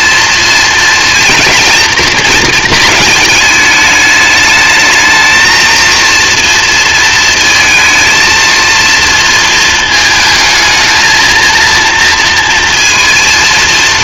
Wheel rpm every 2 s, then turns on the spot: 230, 220, 220, 230, 230, 220, 230.
none